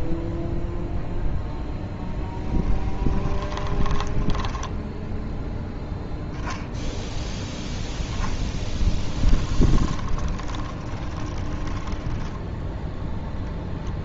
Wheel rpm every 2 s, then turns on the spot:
0, 10, 0, 10, 10, 20, 10.
2-4 8-12